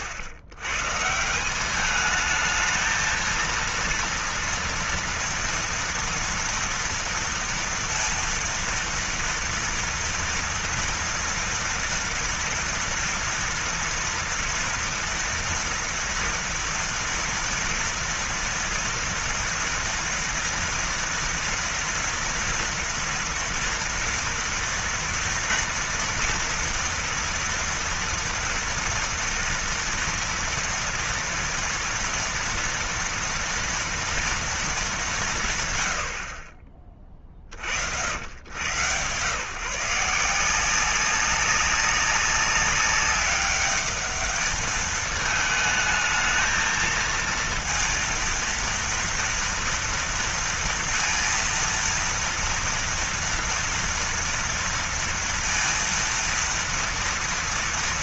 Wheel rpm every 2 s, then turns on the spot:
110, 220, 230, 230, 230, 240, 230, 230, 230, 230, 230, 230, 230, 240, 230, 240, 240, 220, 40, 110, 180, 200, 210, 220, 230, 230, 230, 230, 230.
none